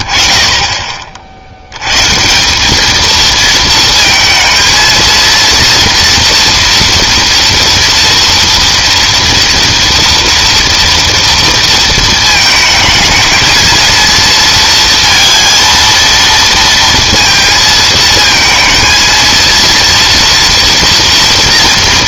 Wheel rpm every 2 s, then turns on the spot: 60, 160, 230, 240, 230, 230, 220, 230, 230, 230, 230.
none